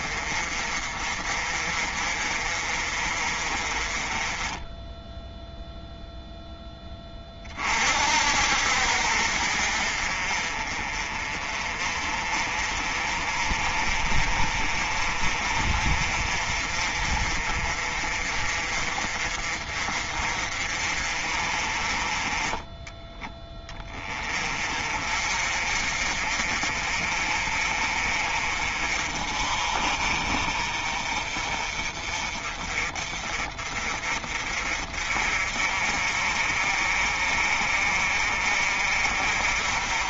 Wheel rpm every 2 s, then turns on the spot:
40, 40, 10, 20, 60, 40, 40, 40, 40, 40, 40, 20, 40, 40, 40, 40, 40, 50, 40, 50.
none